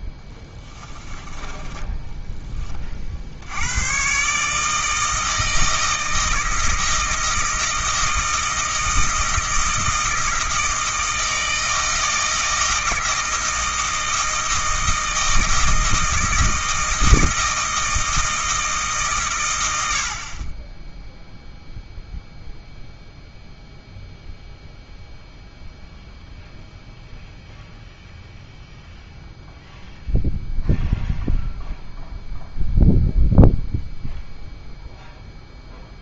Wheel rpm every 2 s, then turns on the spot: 30, 20, 150, 160, 160, 160, 160, 160, 160, 160, 20, 0, 0, 0, 0, 0, 0, 0.
0-2